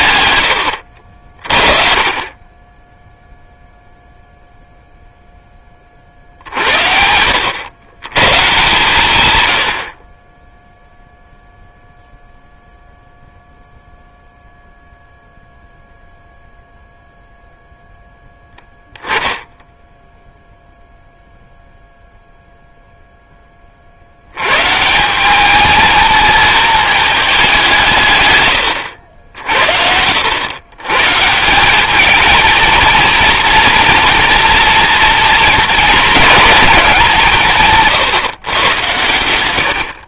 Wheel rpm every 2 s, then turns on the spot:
90, 20, 0, 50, 130, 20, 0, 0, 0, 0, 0, 0, 100, 220, 130, 100, 220, 230, 220, 120.
0-2